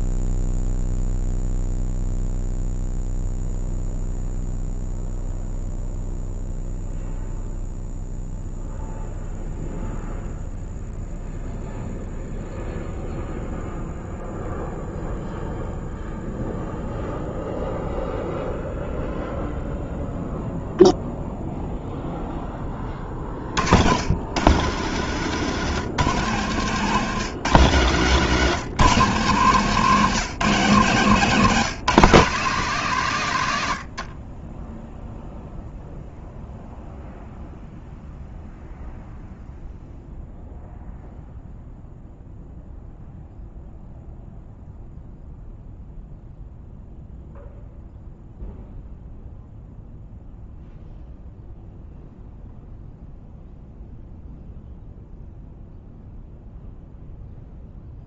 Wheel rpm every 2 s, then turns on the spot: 0, 0, 0, 0, 0, 0, 0, 0, 0, 0, 0, 10, 120, 130, 180, 170, 170, 10, 0, 0, 0, 0, 0, 0, 0, 0, 0, 0, 0.
34-36